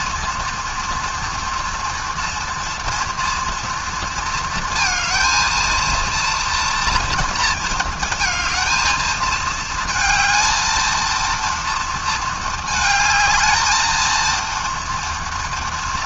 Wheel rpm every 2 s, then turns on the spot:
230, 230, 230, 230, 220, 220, 220, 230.
none